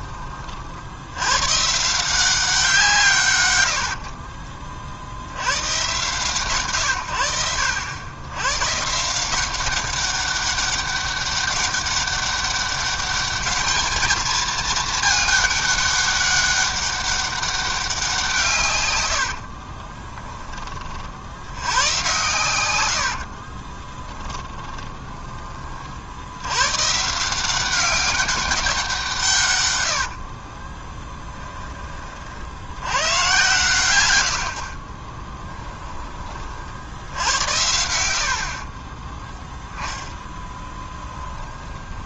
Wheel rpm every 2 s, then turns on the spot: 70, 170, 50, 110, 140, 200, 200, 220, 200, 100, 40, 80, 20, 150, 170, 20, 90, 30, 70, 20, 10.
18-20 22-26 30-32 34-36 38-42